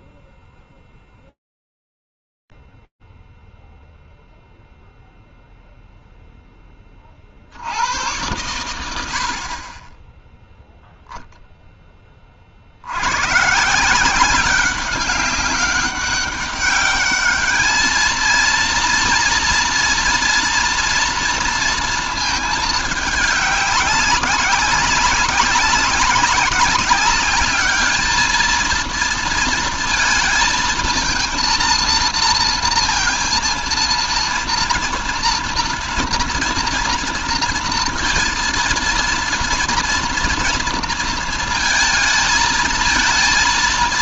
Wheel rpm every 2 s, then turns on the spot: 0, 0, 0, 0, 80, 10, 30, 180, 200, 220, 230, 230, 200, 190, 220, 220, 230, 230, 230, 230, 230, 220.
none